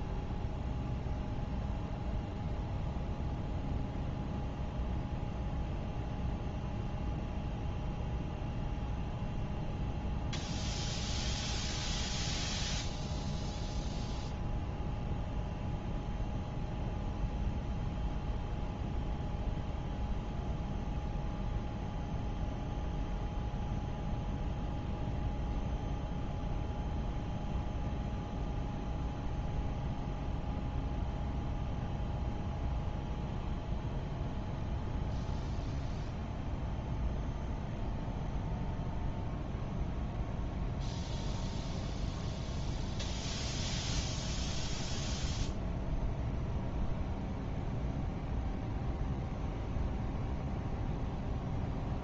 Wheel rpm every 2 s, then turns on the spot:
0, 0, 0, 0, 0, 0, 0, 0, 0, 0, 0, 0, 0, 0, 0, 0, 0, 0, 0, 0, 0, 0, 0, 0, 0, 0.
none